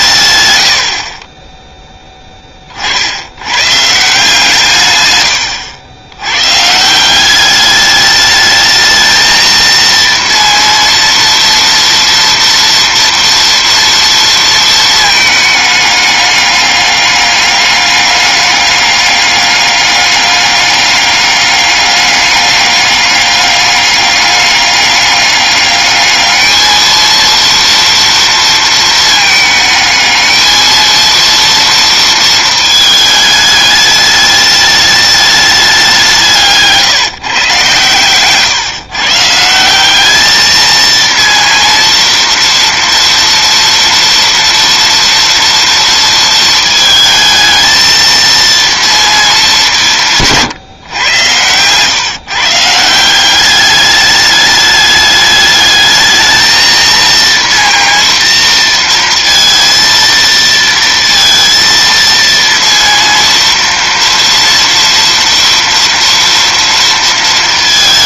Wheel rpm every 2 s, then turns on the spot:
70, 60, 120, 170, 220, 230, 230, 220, 200, 200, 200, 200, 200, 230, 220, 230, 220, 210, 150, 140, 230, 230, 230, 220, 220, 120, 170, 210, 230, 230, 230, 230, 230, 230.
none